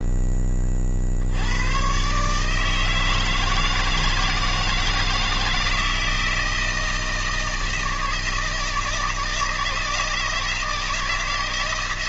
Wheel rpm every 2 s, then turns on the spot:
60, 160, 160, 160, 160, 160.
none